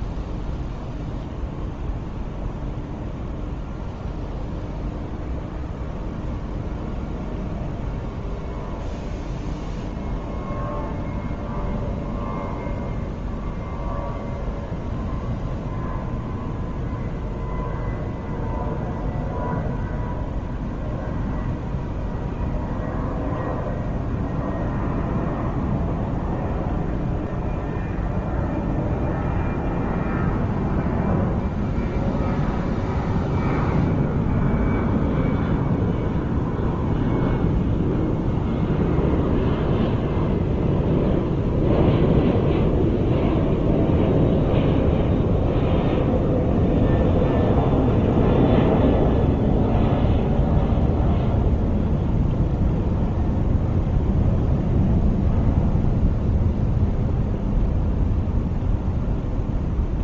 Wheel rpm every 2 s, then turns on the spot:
0, 0, 0, 0, 0, 0, 0, 0, 0, 0, 0, 0, 0, 0, 0, 0, 0, 0, 0, 0, 0, 0, 0, 0, 0, 0, 0, 0, 0, 0.
none